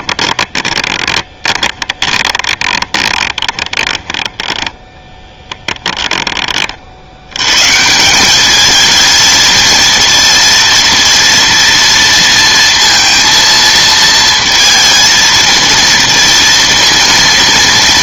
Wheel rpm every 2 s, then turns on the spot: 20, 20, 10, 40, 210, 230, 230, 230, 230.
0-6